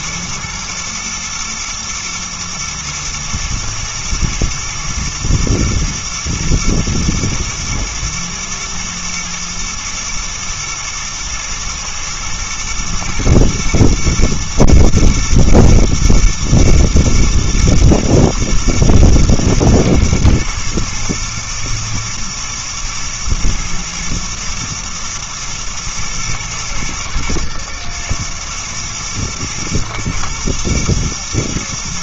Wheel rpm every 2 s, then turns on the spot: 110, 120, 120, 120, 120, 120, 120, 110, 110, 120, 110, 120, 120, 120, 120, 120.
none